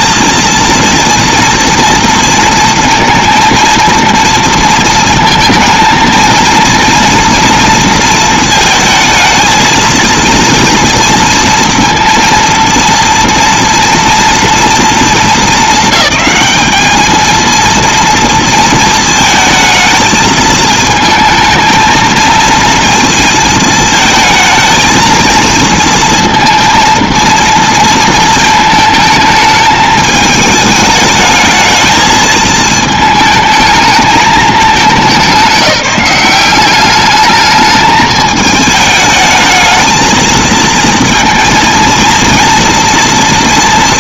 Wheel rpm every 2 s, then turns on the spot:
230, 230, 230, 230, 220, 230, 230, 230, 220, 230, 220, 230, 230, 230, 220, 210, 210, 200, 190, 220, 230, 230.
none